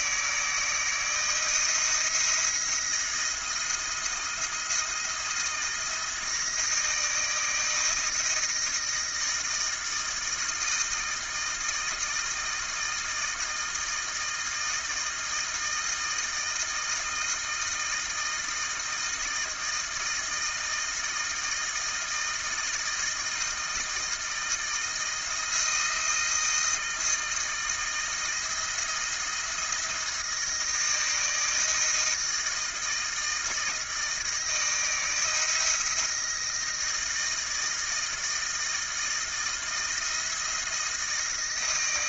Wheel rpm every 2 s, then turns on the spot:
160, 170, 170, 160, 160, 160, 160, 160, 160, 160, 160, 160, 160, 160, 170, 160, 160, 160, 160, 160, 160.
none